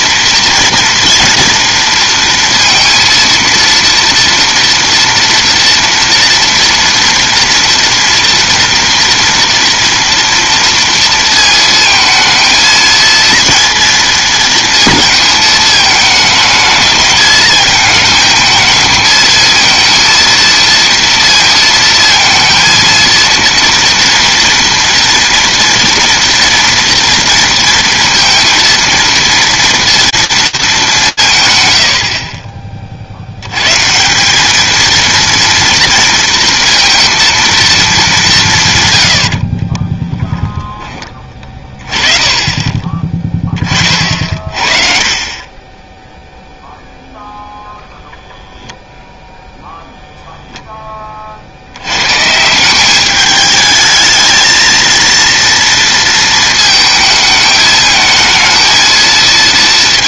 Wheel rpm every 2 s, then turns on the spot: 230, 230, 230, 230, 230, 230, 230, 230, 220, 220, 230, 230, 230, 230, 230, 210, 30, 220, 230, 130, 10, 20, 40, 0, 10, 20, 200, 230, 220, 220.
none